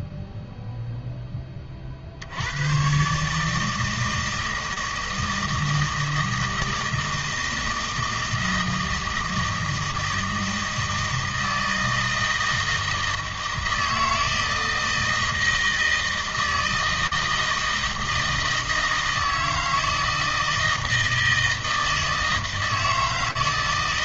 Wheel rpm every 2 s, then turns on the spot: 0, 110, 160, 160, 160, 160, 160, 160, 160, 160, 160, 160.
none